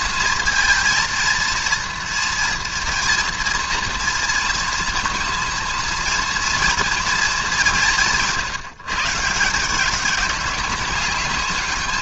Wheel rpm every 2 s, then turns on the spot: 230, 230, 230, 230, 170, 200.
none